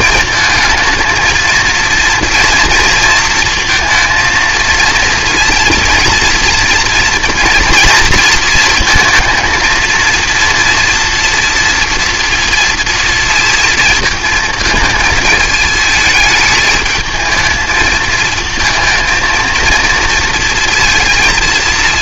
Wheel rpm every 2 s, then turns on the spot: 220, 230, 230, 230, 230, 230, 230, 220, 220, 230, 230.
none